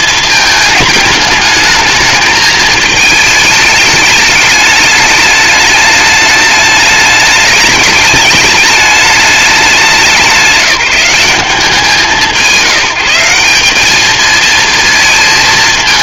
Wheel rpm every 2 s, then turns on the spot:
220, 220, 210, 210, 210, 180, 160, 230.
none